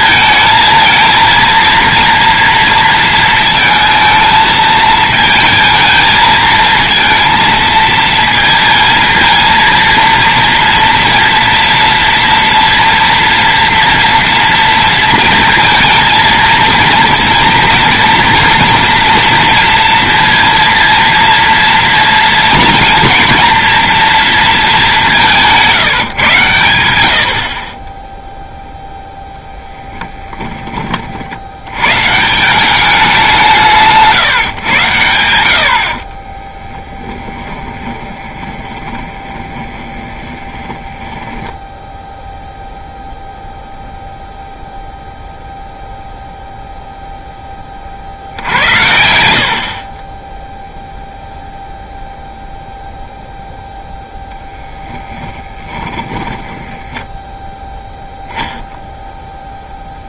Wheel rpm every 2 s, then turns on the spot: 220, 230, 220, 220, 230, 230, 230, 230, 230, 230, 230, 230, 220, 100, 0, 20, 190, 120, 20, 20, 20, 0, 0, 0, 70, 0, 0, 10, 10, 0.
36-42 48-50 56-58